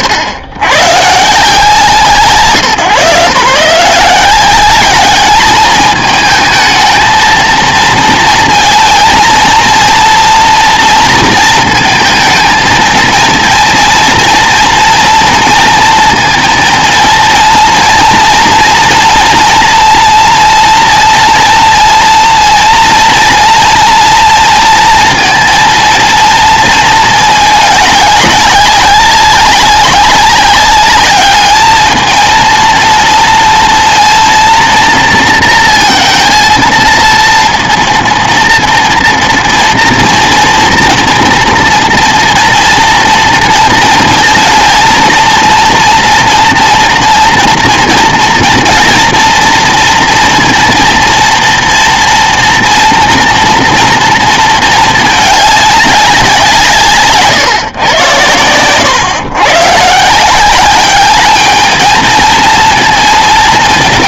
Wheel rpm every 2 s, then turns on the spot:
90, 140, 190, 220, 230, 230, 230, 230, 230, 230, 230, 230, 230, 230, 200, 200, 230, 230, 230, 230, 240, 230, 230, 230, 230, 230, 230, 220, 160, 110, 200, 230.
none